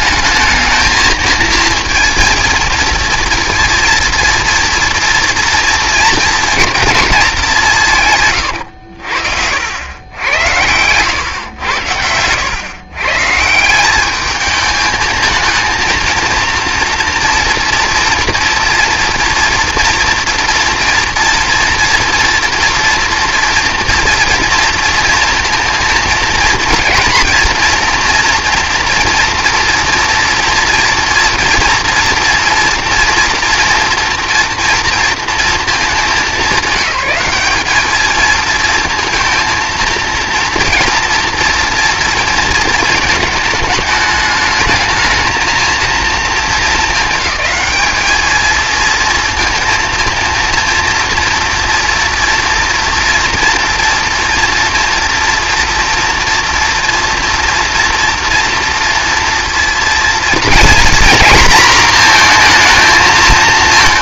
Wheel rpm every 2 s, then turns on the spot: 220, 230, 240, 230, 100, 100, 130, 220, 240, 230, 230, 240, 230, 230, 230, 230, 230, 230, 200, 230, 230, 220, 220, 220, 230, 230, 230, 230, 240, 230, 240, 230.
8-10